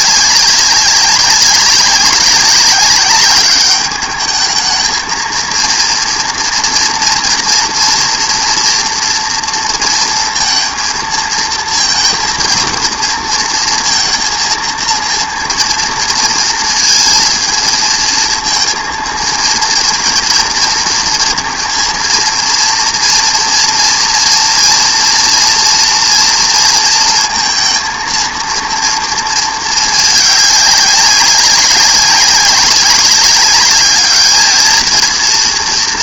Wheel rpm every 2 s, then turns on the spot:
190, 190, 220, 240, 230, 230, 230, 230, 230, 230, 230, 230, 230, 230, 230, 200, 200, 220.
none